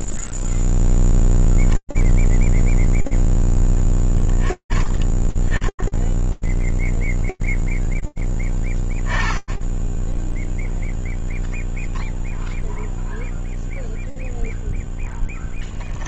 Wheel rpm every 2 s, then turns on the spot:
0, 0, 10, 0, 10, 0, 0, 0.
none